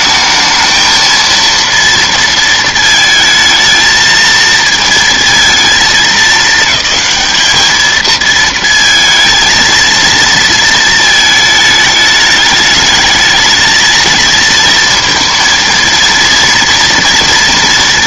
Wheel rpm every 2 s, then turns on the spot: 220, 220, 230, 210, 220, 230, 210, 230, 230.
none